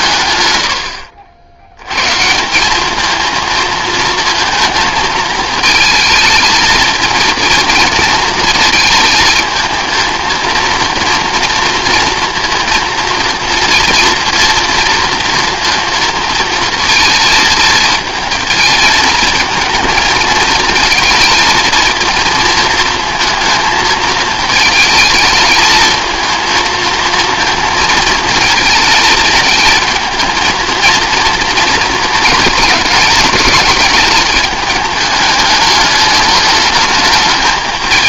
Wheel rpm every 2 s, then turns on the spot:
100, 200, 220, 220, 220, 230, 230, 230, 230, 220, 230, 230, 220, 230, 220, 230, 220, 210, 210.
none